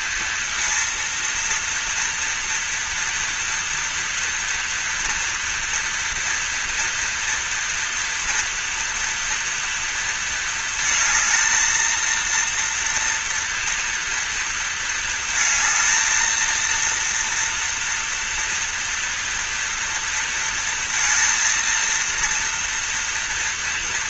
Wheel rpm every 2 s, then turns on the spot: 230, 230, 230, 230, 230, 220, 240, 230, 230, 240, 230, 230.
none